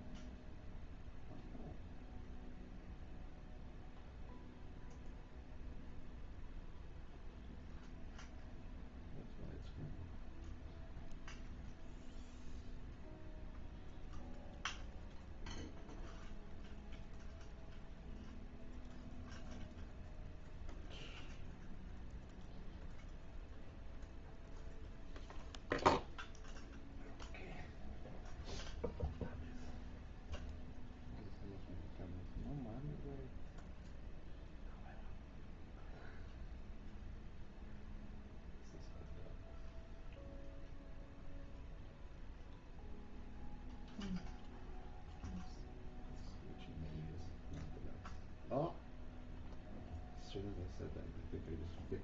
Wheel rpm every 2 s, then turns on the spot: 0, 0, 0, 0, 0, 0, 0, 0, 0, 0, 0, 0, 0, 0, 0, 0, 0, 0, 0, 0, 0, 0, 0, 0, 0, 0.
none